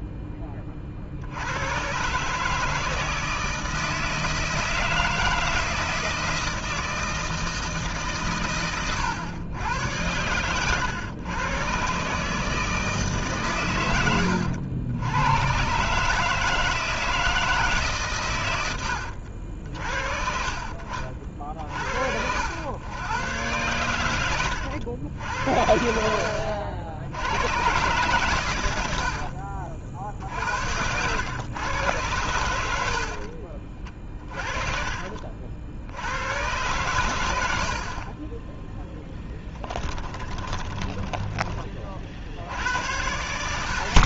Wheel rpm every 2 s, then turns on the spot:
50, 160, 160, 160, 130, 120, 150, 80, 160, 90, 40, 110, 100, 70, 90, 90, 70, 40, 110, 10, 10, 80.
28-30 38-42